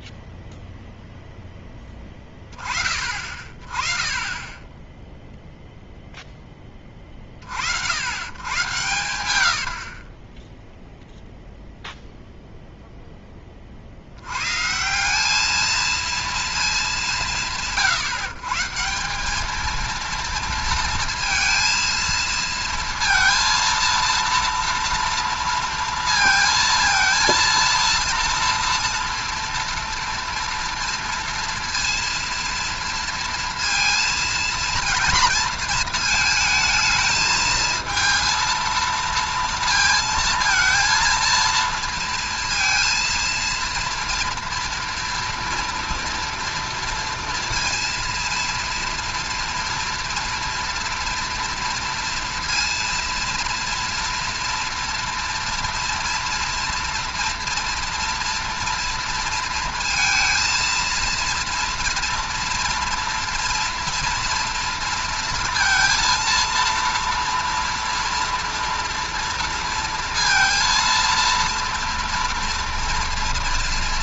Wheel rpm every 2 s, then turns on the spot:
0, 30, 10, 20, 130, 0, 0, 140, 220, 140, 230, 230, 230, 230, 230, 230, 230, 230, 220, 220, 230, 230, 240, 230, 230, 230, 230, 230, 230, 230, 230, 240, 230, 230, 230, 230, 230.
8-10